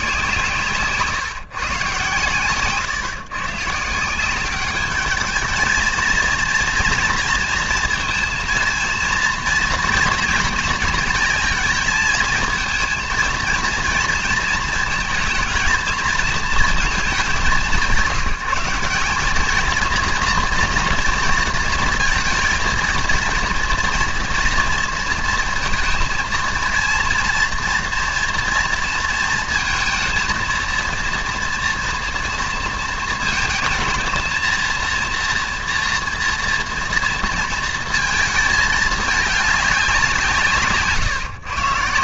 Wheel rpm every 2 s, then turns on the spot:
160, 120, 190, 230, 230, 230, 230, 230, 220, 190, 230, 230, 230, 230, 230, 230, 230, 230, 230, 220, 160.
0-4